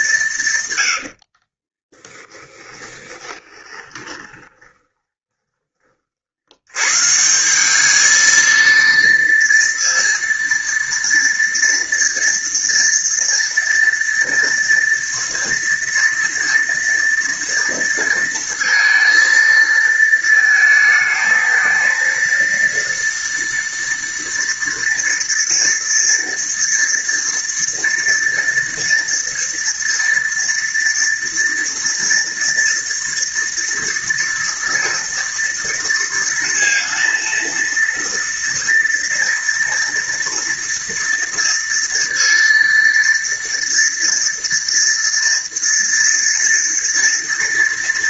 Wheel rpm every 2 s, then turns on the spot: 90, 20, 10, 130, 230, 230, 230, 230, 230, 230, 220, 240, 230, 230, 230, 230, 230, 230, 230, 230, 230, 230, 230, 230.
2-6